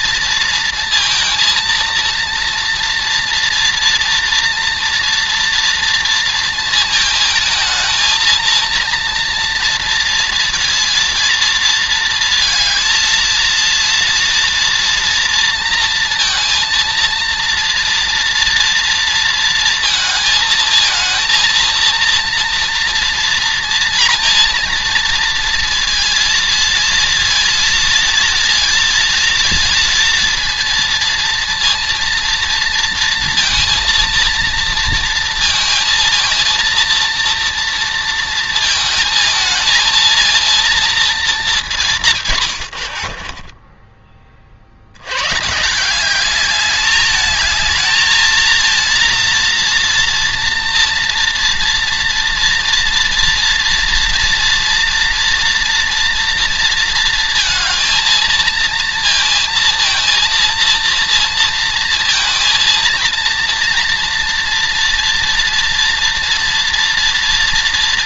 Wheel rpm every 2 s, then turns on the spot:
230, 230, 240, 230, 230, 230, 230, 230, 230, 230, 220, 230, 230, 230, 230, 230, 230, 230, 230, 220, 230, 100, 70, 210, 230, 230, 230, 230, 230, 230, 230, 230, 230, 230.
42-44